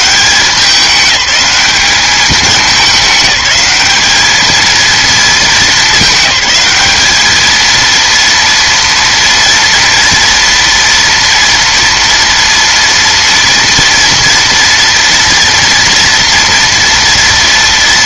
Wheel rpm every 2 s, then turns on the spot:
190, 210, 220, 210, 230, 230, 230, 230, 230.
none